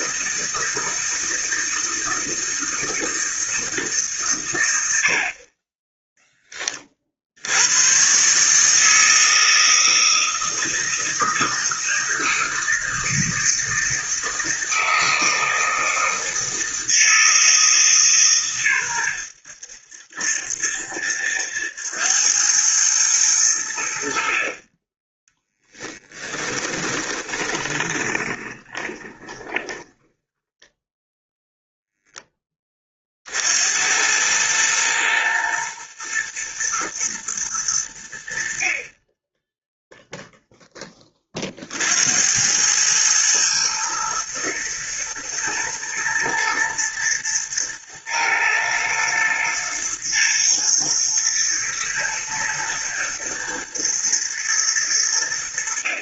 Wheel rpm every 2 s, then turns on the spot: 160, 160, 80, 30, 160, 160, 160, 160, 160, 110, 70, 110, 30, 20, 20, 10, 30, 110, 120, 30, 10, 100, 120, 110, 110, 110, 110, 100.
26-32